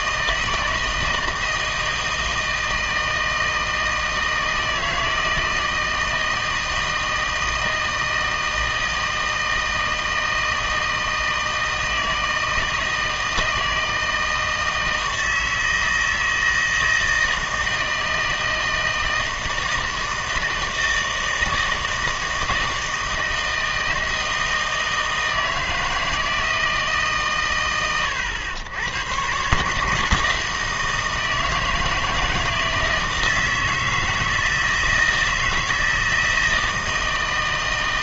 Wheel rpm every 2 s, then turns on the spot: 160, 160, 160, 160, 160, 160, 160, 160, 160, 160, 160, 160, 160, 160, 100, 160, 160, 160, 160.
none